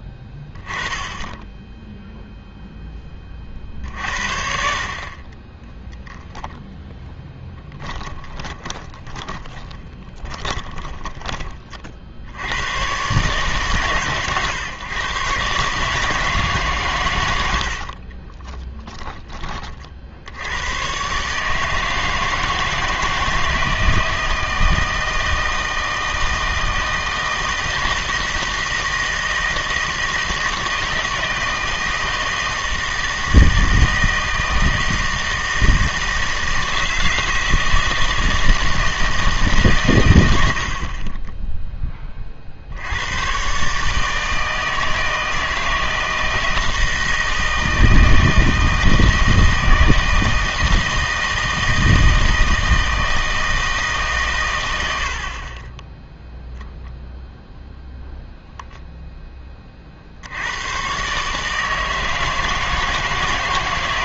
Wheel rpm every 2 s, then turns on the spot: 10, 10, 60, 0, 20, 20, 100, 130, 140, 10, 100, 160, 160, 160, 160, 160, 160, 160, 160, 160, 60, 60, 160, 160, 160, 160, 160, 110, 0, 0, 100, 160.
8-12 18-20